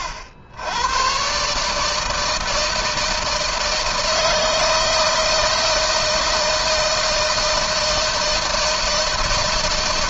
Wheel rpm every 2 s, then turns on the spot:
90, 160, 160, 160, 160.
none